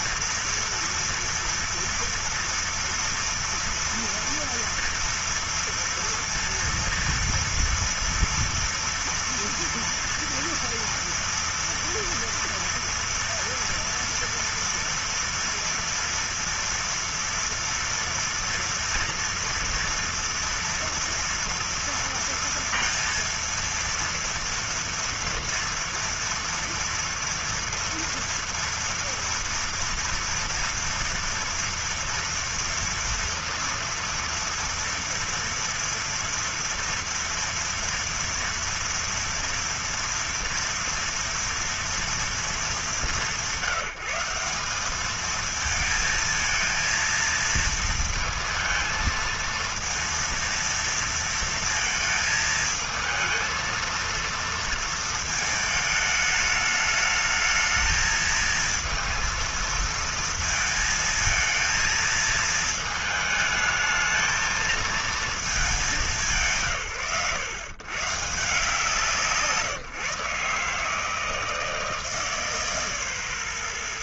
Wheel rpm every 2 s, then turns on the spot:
230, 230, 240, 230, 230, 230, 230, 230, 230, 240, 230, 230, 230, 230, 230, 230, 230, 230, 230, 230, 230, 190, 200, 230, 230, 230, 220, 230, 210, 230, 230, 220, 220, 130, 160, 150, 140.
none